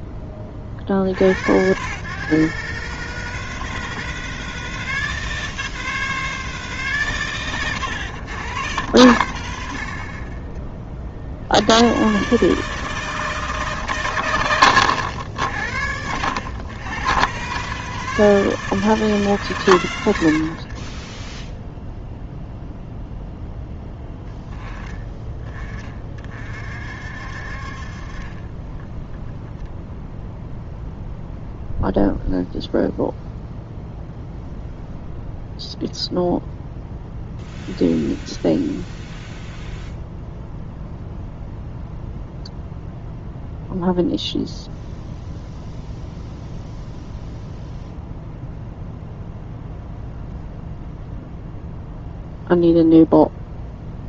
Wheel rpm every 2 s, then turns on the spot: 50, 150, 160, 140, 120, 40, 160, 80, 110, 160, 40, 0, 20, 50, 20, 0, 0, 0, 0, 0, 0, 0, 0, 0, 0, 0, 0.
20-22 28-30